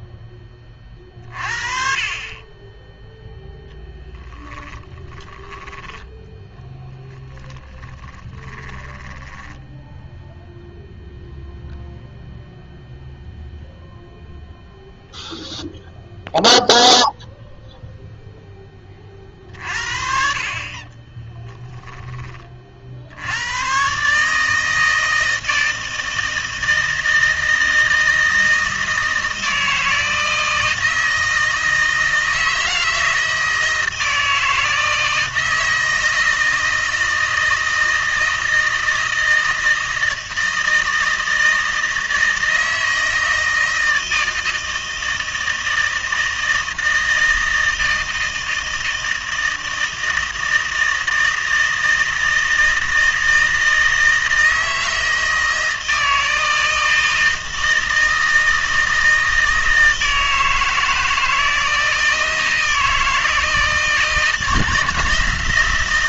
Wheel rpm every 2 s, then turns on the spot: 30, 20, 10, 10, 20, 0, 0, 0, 0, 20, 40, 40, 160, 160, 160, 160, 160, 160, 160, 160, 160, 160, 160, 160, 160, 160, 160, 160, 160, 160, 160, 160, 160.
4-6 8-10